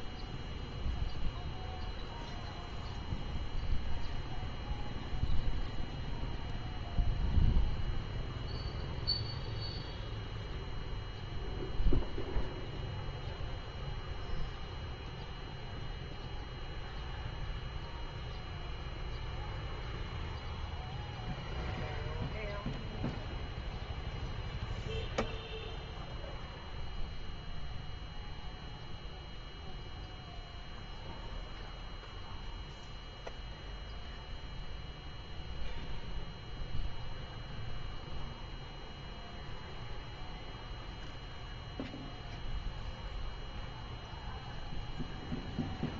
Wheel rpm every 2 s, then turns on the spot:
0, 0, 0, 0, 0, 0, 0, 0, 0, 0, 0, 0, 0, 0, 0, 0, 0, 0, 0, 0, 0, 0, 0.
none